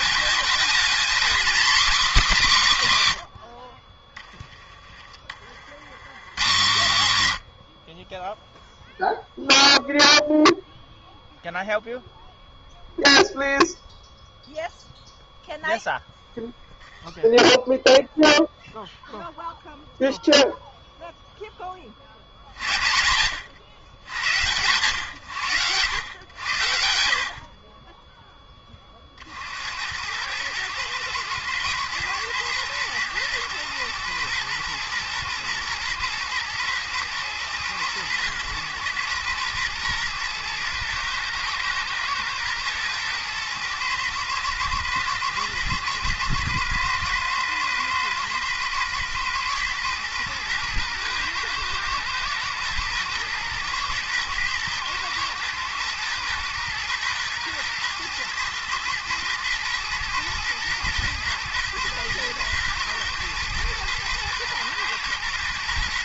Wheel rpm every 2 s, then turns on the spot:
230, 200, 20, 140, 0, 0, 0, 0, 0, 0, 0, 60, 120, 90, 20, 110, 110, 110, 110, 120, 120, 120, 110, 110, 120, 110, 120, 110, 110, 110, 120, 110, 120.
none